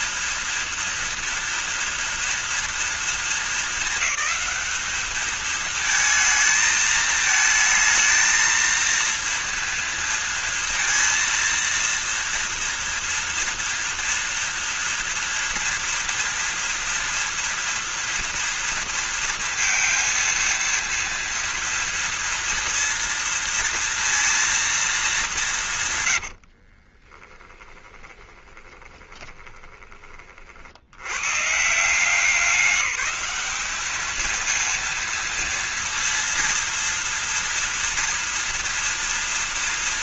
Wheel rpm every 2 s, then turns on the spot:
230, 230, 210, 220, 230, 230, 230, 230, 230, 230, 230, 230, 230, 90, 20, 60, 190, 230, 230, 230.
26-30